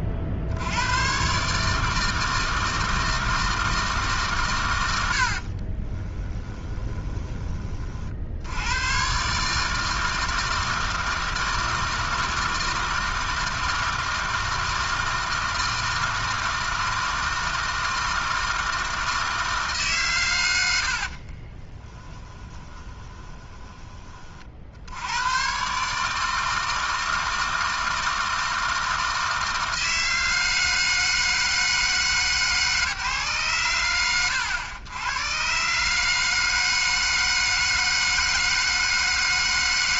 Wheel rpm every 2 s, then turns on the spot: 80, 160, 100, 20, 110, 160, 160, 160, 160, 160, 60, 20, 50, 160, 160, 160, 150, 100, 160, 160.
4-8 22-24